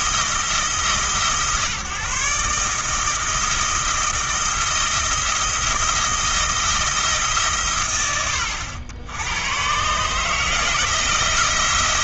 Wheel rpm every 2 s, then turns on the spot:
150, 160, 160, 160, 90, 160.
none